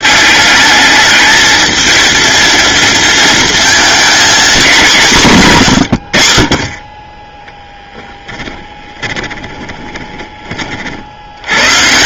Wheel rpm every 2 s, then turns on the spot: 210, 230, 200, 30, 20, 50.
8-10